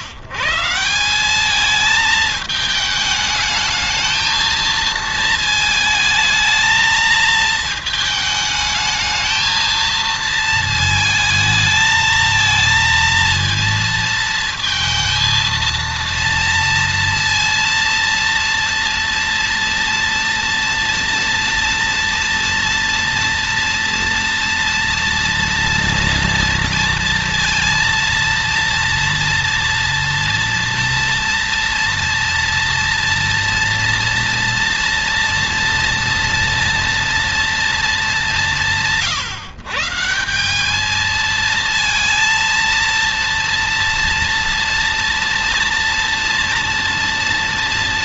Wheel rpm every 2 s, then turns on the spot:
130, 220, 220, 220, 220, 220, 220, 230, 230, 230, 240, 230, 230, 230, 230, 230, 230, 230, 230, 150, 180, 230, 230, 230.
none